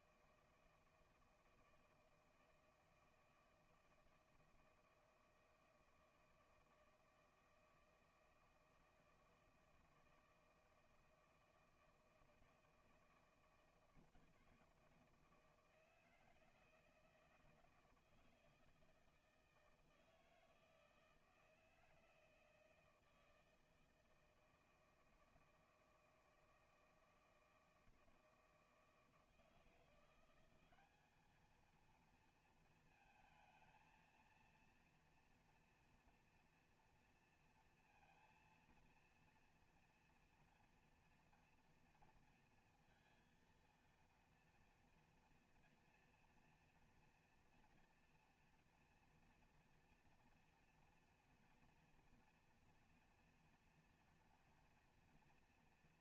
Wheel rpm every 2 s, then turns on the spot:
160, 160, 160, 160, 160, 160, 160, 160, 160, 160, 160, 160, 160, 160, 160, 200, 220, 230, 230, 230, 230, 230, 240, 230, 230, 230, 240, 230.
none